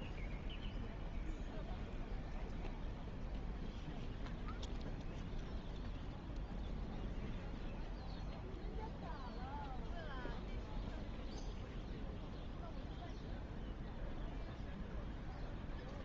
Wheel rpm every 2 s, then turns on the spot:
0, 0, 0, 0, 0, 0, 0, 0.
none